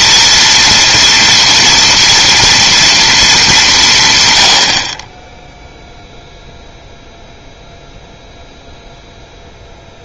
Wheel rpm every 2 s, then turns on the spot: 230, 230, 80, 0, 0.
none